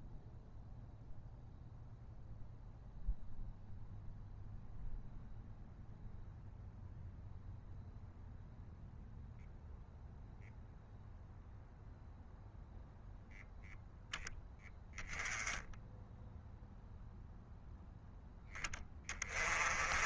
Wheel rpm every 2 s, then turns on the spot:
0, 0, 0, 0, 0, 0, 0, 0, 0, 20.
none